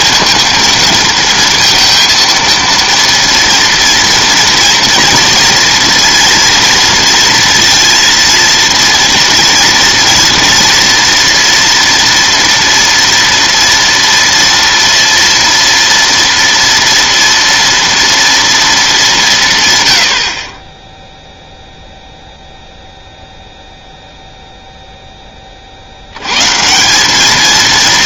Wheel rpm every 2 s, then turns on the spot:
230, 230, 230, 230, 230, 230, 230, 230, 230, 210, 20, 0, 0, 160.
none